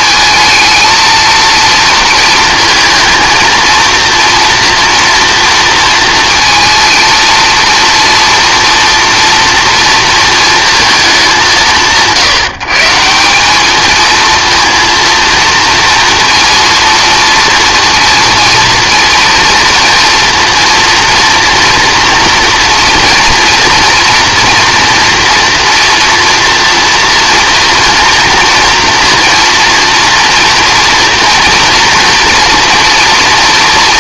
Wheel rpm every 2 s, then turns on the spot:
220, 220, 240, 230, 230, 220, 150, 230, 230, 230, 230, 240, 230, 230, 230, 230, 230.
none